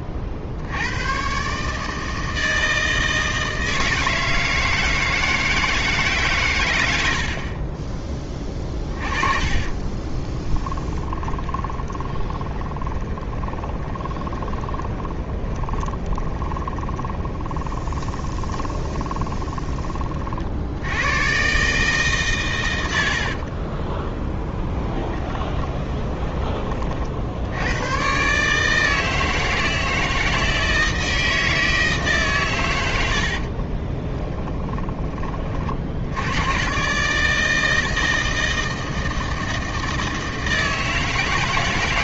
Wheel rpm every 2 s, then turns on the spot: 90, 160, 160, 90, 30, 20, 30, 20, 20, 20, 80, 90, 20, 30, 160, 160, 100, 10, 130, 160, 160.
8-20 24-26